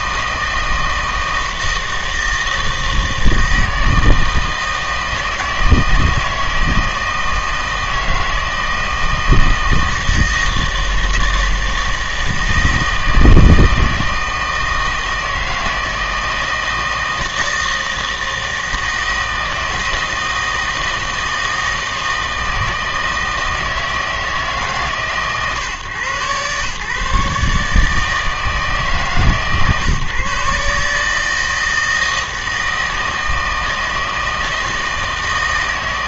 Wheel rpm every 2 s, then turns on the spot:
160, 160, 160, 160, 160, 160, 160, 160, 160, 160, 160, 160, 150, 130, 150, 150, 160, 160.
none